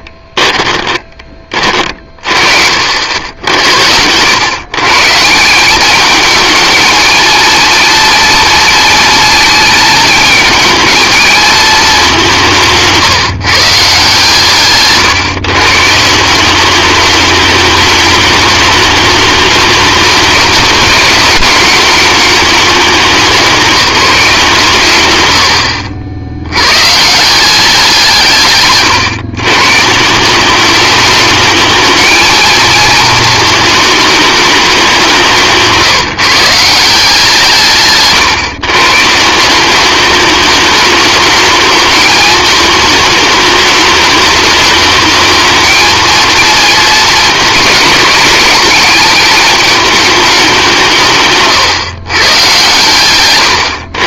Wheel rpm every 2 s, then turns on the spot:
20, 70, 140, 220, 230, 220, 170, 140, 200, 210, 210, 200, 140, 140, 130, 200, 230, 200, 170, 140, 210, 210, 210, 220, 210, 170, 120.
0-2 12-14